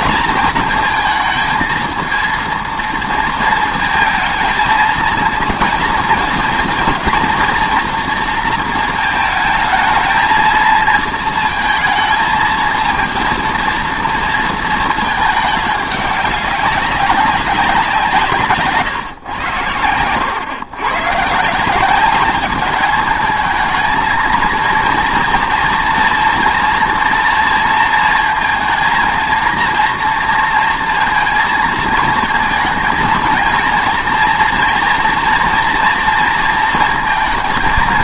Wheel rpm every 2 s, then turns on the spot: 220, 230, 220, 220, 220, 230, 220, 220, 200, 150, 120, 210, 230, 230, 230, 230, 230, 230, 230.
18-20